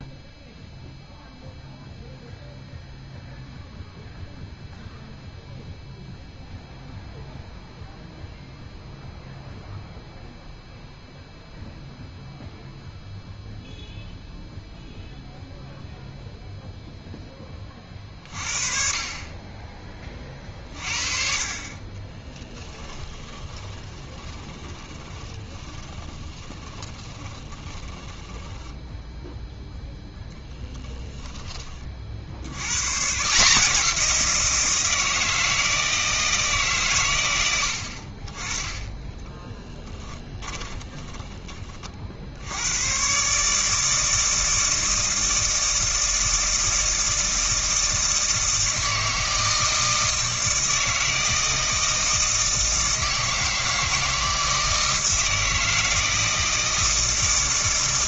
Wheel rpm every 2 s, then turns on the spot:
0, 0, 0, 0, 0, 0, 0, 0, 0, 40, 40, 10, 20, 20, 10, 0, 90, 170, 150, 20, 30, 80, 160, 160, 160, 160, 160, 160, 160.
22-30 40-42